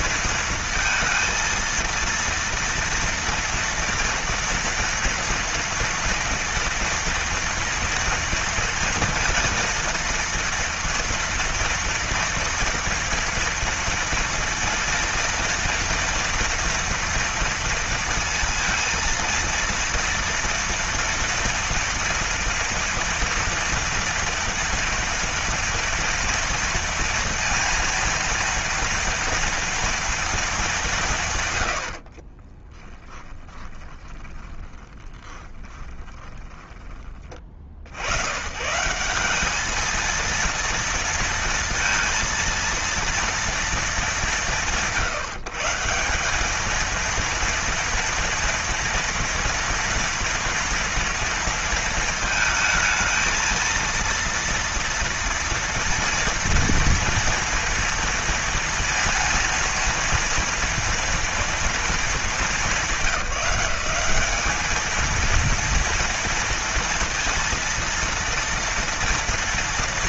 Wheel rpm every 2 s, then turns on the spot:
230, 230, 230, 230, 230, 230, 230, 230, 230, 230, 230, 240, 230, 230, 230, 190, 20, 20, 20, 160, 230, 230, 150, 220, 230, 230, 220, 230, 230, 230, 230, 200, 220, 230, 230.
32-36